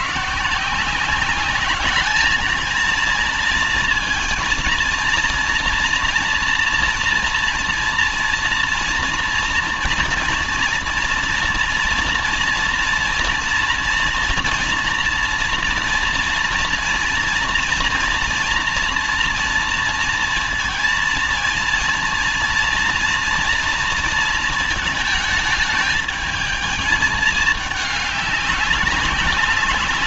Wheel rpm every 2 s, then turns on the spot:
160, 220, 230, 230, 230, 230, 230, 230, 230, 230, 230, 230, 220, 210, 200.
none